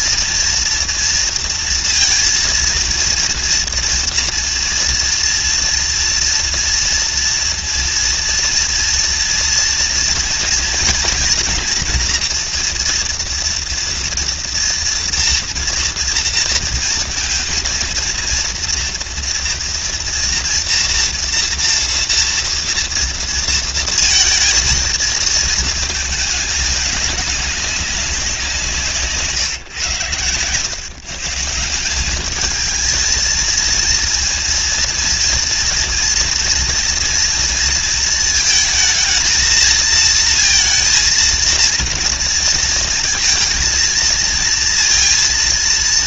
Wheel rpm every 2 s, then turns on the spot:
230, 230, 230, 230, 230, 230, 230, 230, 230, 240, 230, 230, 230, 200, 150, 160, 230, 230, 230, 220, 230, 230, 230.
none